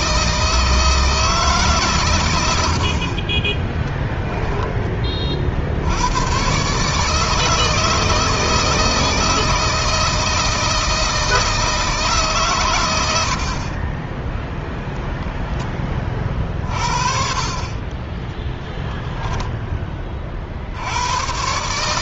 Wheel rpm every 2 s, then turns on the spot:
160, 70, 20, 140, 160, 160, 110, 10, 50, 0, 70.
none